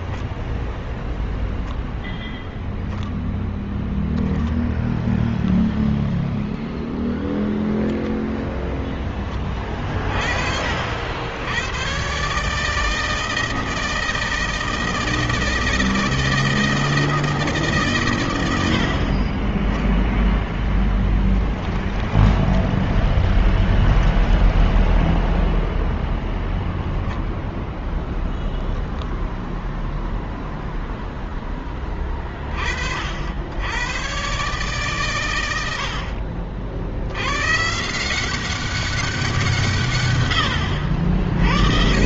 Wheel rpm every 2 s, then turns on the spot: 0, 0, 10, 10, 10, 40, 130, 160, 160, 120, 10, 20, 20, 0, 0, 0, 30, 110, 70, 170, 110.
22-26